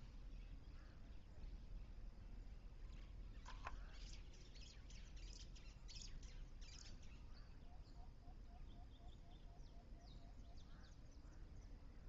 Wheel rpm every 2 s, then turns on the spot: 0, 0, 0, 0, 0, 0.
none